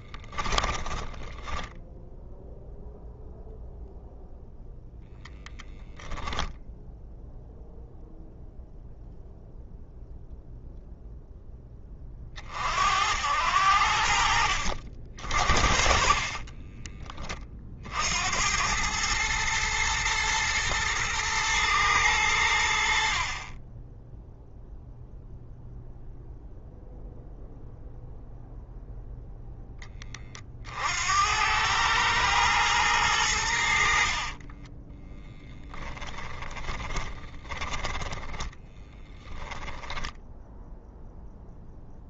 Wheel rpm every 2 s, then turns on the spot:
10, 0, 10, 10, 0, 0, 70, 70, 40, 110, 110, 60, 0, 0, 0, 60, 110, 30, 20, 10, 10.
0-2 16-18 34-42